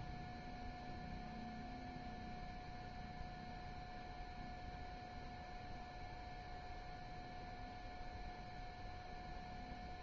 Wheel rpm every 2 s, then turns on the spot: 0, 0, 0, 0, 0.
none